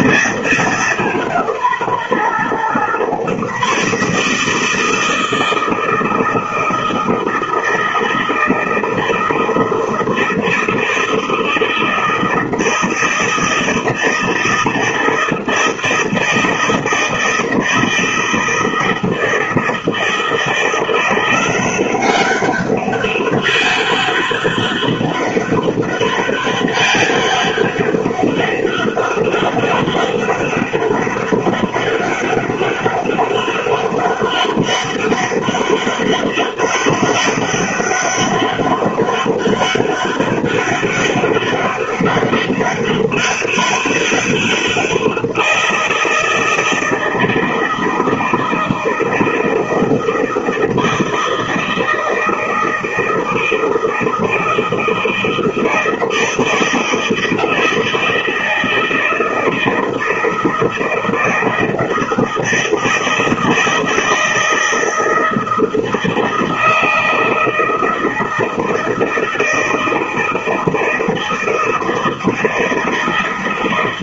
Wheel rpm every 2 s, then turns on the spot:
190, 130, 160, 160, 160, 160, 160, 160, 160, 160, 170, 200, 200, 200, 200, 200, 200, 200, 200, 200, 200, 200, 180, 160, 160, 160, 160, 160, 160, 160, 160, 160, 160, 160, 160, 160, 160.
none